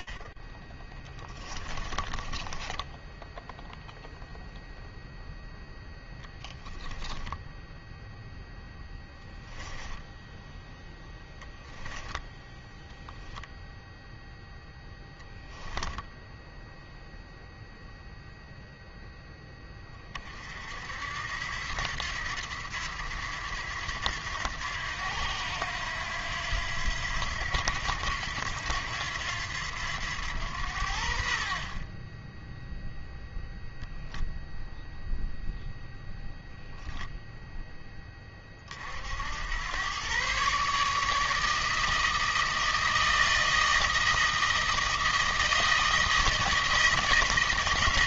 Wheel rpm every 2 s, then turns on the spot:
10, 10, 0, 10, 10, 0, 10, 10, 0, 20, 80, 90, 90, 90, 90, 50, 0, 0, 0, 80, 150, 160, 160, 160.
0-4 6-8 12-16